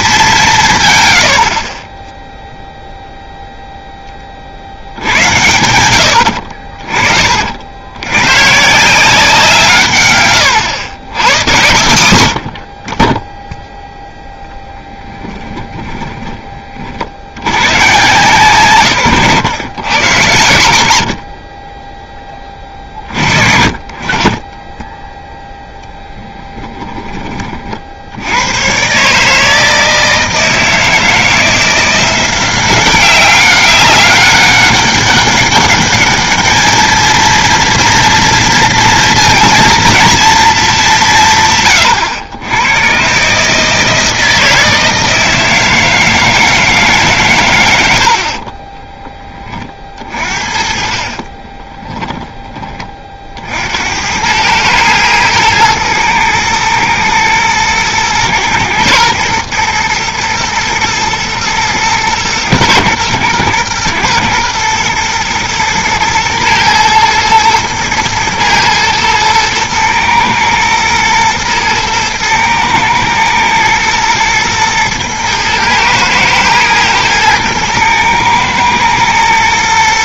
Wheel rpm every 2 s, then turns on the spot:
170, 0, 70, 50, 140, 120, 50, 0, 20, 130, 80, 30, 20, 10, 110, 160, 180, 200, 220, 230, 220, 110, 160, 160, 20, 50, 20, 110, 110, 120, 120, 120, 120, 110, 110, 120, 110, 110, 110, 110.
6-8 10-12 48-50